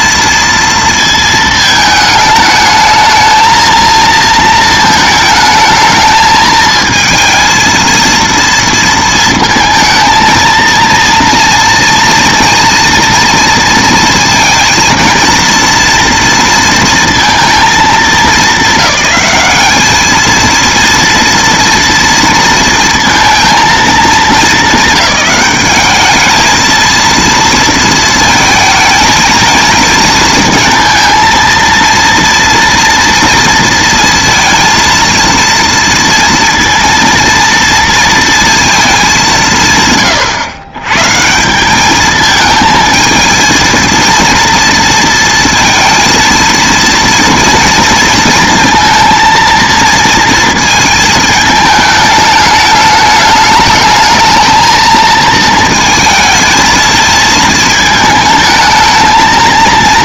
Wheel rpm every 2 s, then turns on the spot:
230, 220, 230, 220, 230, 230, 230, 230, 230, 210, 230, 230, 210, 220, 220, 230, 230, 230, 230, 220, 130, 220, 230, 230, 230, 220, 210, 220, 220, 220.
none